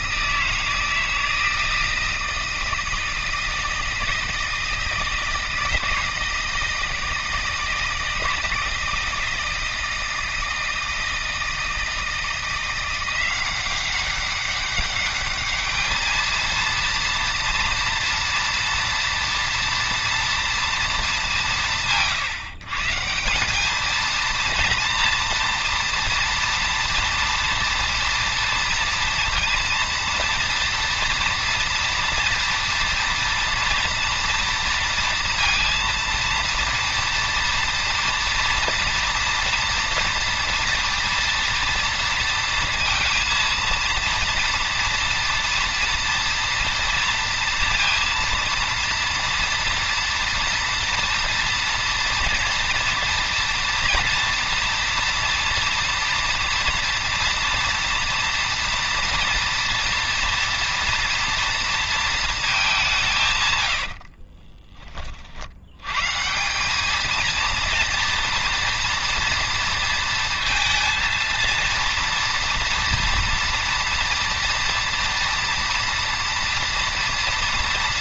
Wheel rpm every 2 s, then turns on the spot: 160, 160, 160, 160, 160, 160, 170, 200, 230, 230, 230, 150, 230, 230, 230, 230, 230, 230, 230, 230, 230, 230, 240, 230, 230, 240, 230, 240, 230, 240, 230, 200, 30, 190, 230, 220, 230, 230, 230.
64-66